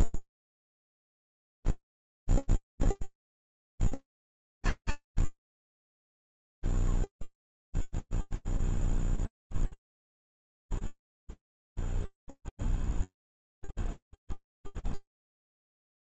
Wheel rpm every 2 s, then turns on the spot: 0, 10, 20, 0, 0, 0, 0, 20.
none